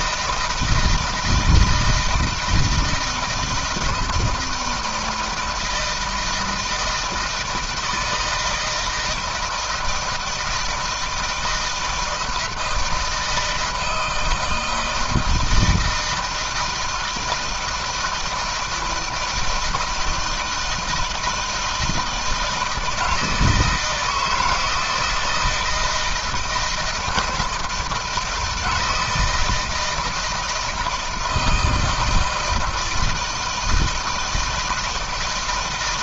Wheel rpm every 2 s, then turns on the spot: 160, 160, 160, 160, 160, 160, 160, 160, 160, 160, 160, 160, 160, 170, 160, 160, 160, 160.
none